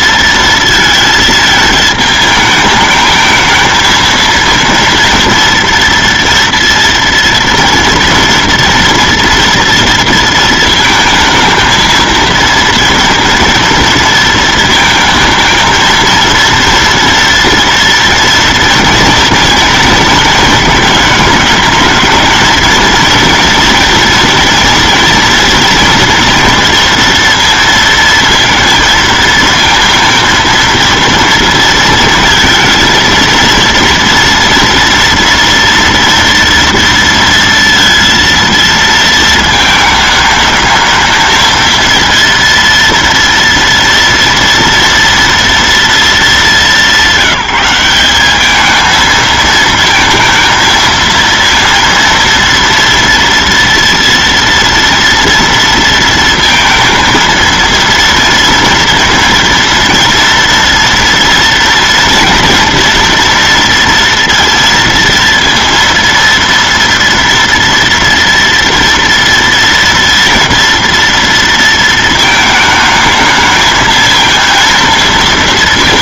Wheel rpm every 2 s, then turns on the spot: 230, 220, 230, 230, 240, 230, 230, 220, 230, 230, 220, 230, 230, 230, 230, 230, 220, 230, 230, 230, 220, 230, 230, 190, 210, 230, 230, 230, 230, 230, 240, 230, 230, 230, 230, 230, 220, 230.
none